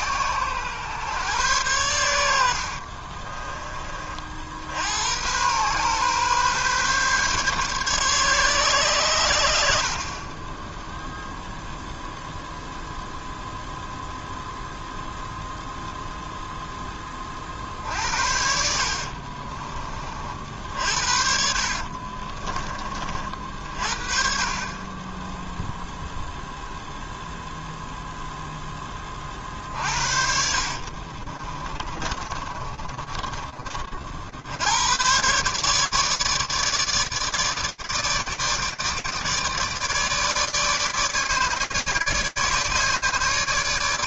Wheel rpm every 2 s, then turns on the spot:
120, 40, 90, 140, 120, 0, 0, 0, 10, 60, 60, 30, 20, 0, 20, 50, 30, 120, 150, 150, 150, 150.
2-4 18-22 30-34